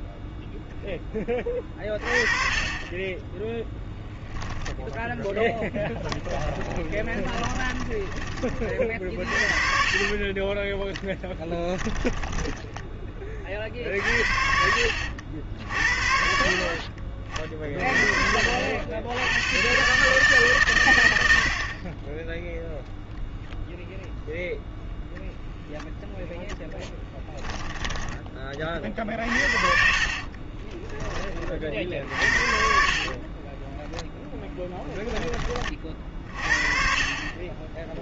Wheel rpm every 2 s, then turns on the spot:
0, 30, 0, 20, 40, 10, 10, 70, 40, 80, 100, 0, 0, 10, 50, 10, 40, 10, 40.
6-12 26-30